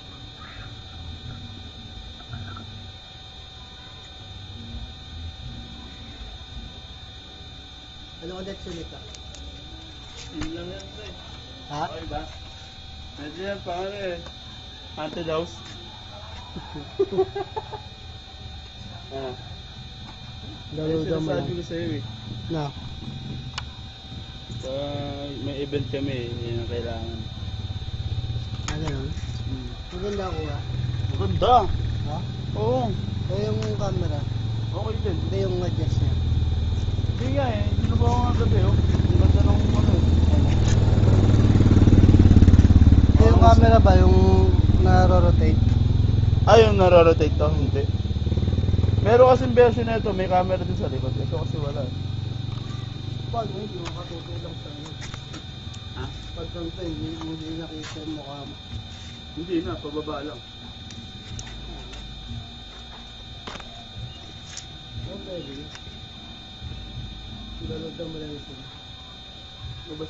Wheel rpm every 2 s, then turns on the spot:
0, 0, 0, 0, 0, 0, 0, 0, 0, 0, 0, 0, 0, 0, 0, 0, 0, 0, 0, 0, 0, 0, 0, 0, 0, 0, 0, 0, 0, 0, 0, 0, 0, 0, 0.
none